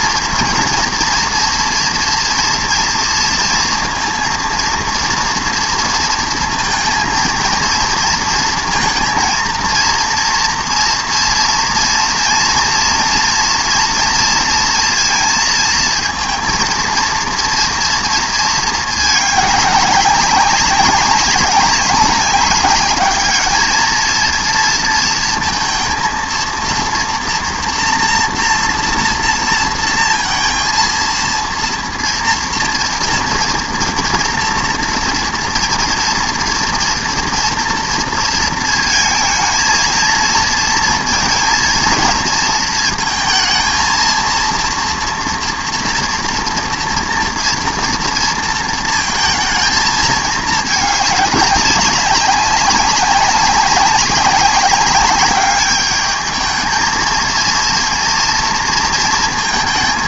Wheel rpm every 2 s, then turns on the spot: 230, 230, 230, 230, 230, 230, 230, 230, 230, 220, 190, 200, 230, 230, 240, 230, 230, 230, 230, 230, 230, 220, 230, 230, 230, 210, 190, 200, 220, 230.
none